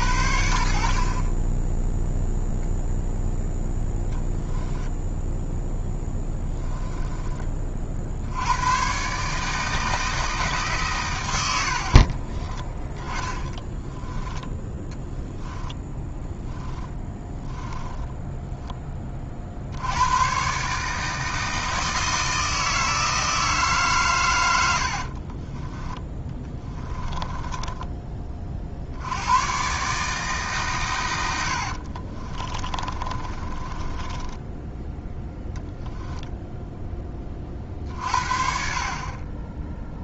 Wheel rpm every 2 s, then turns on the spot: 70, 0, 0, 20, 80, 150, 20, 10, 10, 20, 150, 160, 80, 20, 60, 130, 30, 10, 10, 40.
6-8 12-14 16-18 24-28 32-34